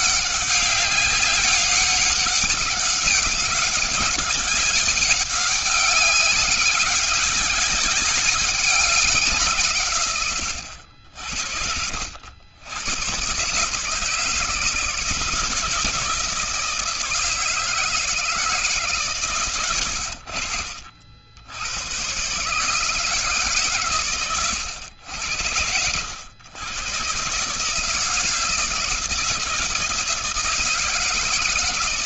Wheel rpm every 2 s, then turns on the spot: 200, 190, 200, 200, 200, 120, 90, 160, 170, 160, 80, 130, 110, 110, 160, 160.
none